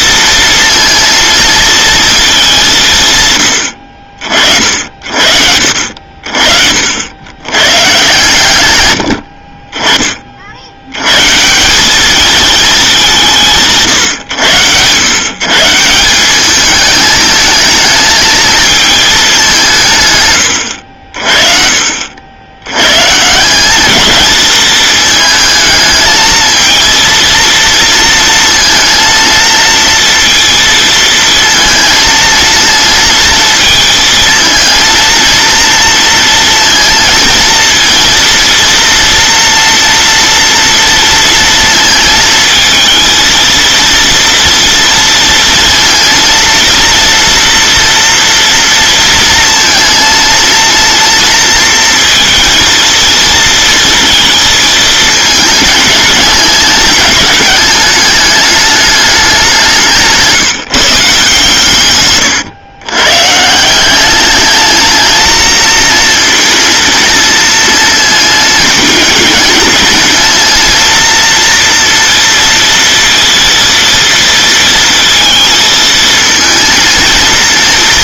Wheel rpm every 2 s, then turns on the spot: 230, 210, 60, 70, 100, 80, 220, 100, 210, 220, 90, 110, 220, 230, 230, 230, 230, 230, 230, 230, 230, 220, 230, 230, 230, 230, 230, 220, 200, 210, 160, 120, 220, 230, 220, 230, 230, 230, 220.
none